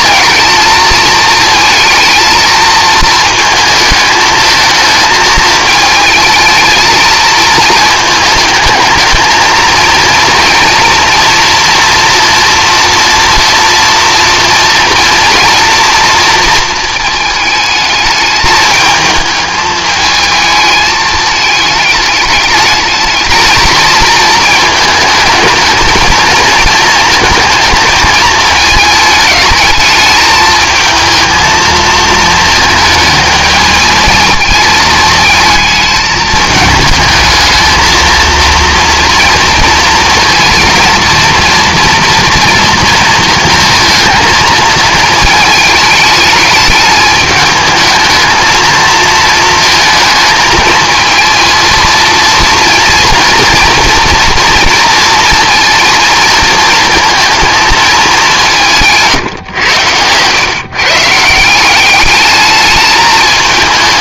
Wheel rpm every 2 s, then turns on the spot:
220, 220, 220, 220, 220, 230, 230, 230, 220, 210, 220, 220, 220, 220, 220, 220, 220, 230, 220, 230, 230, 230, 220, 210, 230, 220, 230, 230, 220, 160, 150, 220.
none